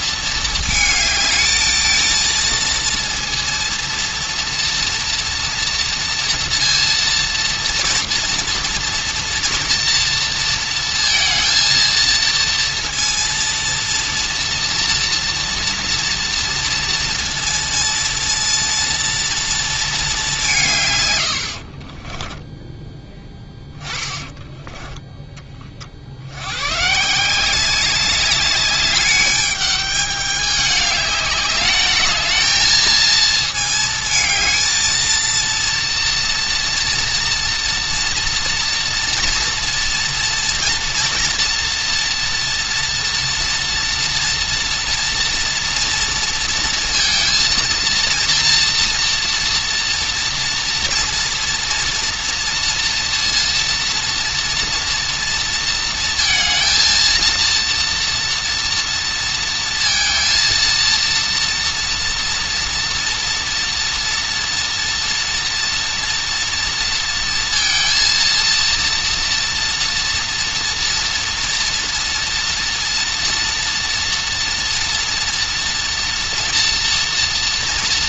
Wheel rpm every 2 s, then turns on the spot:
220, 230, 230, 230, 230, 230, 230, 230, 230, 230, 180, 10, 20, 120, 200, 210, 220, 220, 230, 230, 230, 230, 230, 230, 230, 230, 230, 230, 230, 230, 230, 230, 230, 230, 230, 240, 230, 230, 230.
22-26